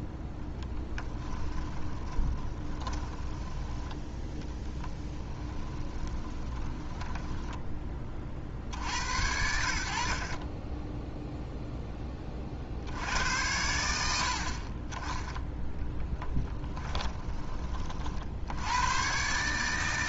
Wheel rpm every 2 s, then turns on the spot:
10, 20, 10, 10, 60, 10, 70, 30, 10, 90.
0-8 16-18